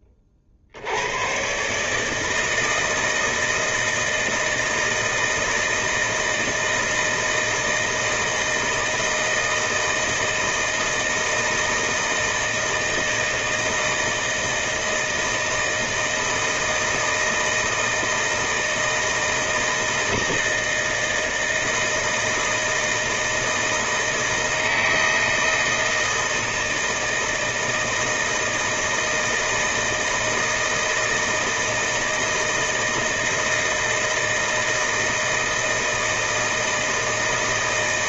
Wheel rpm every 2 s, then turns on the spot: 50, 160, 160, 160, 160, 160, 160, 160, 160, 160, 160, 160, 160, 160, 160, 160, 160, 160, 160.
none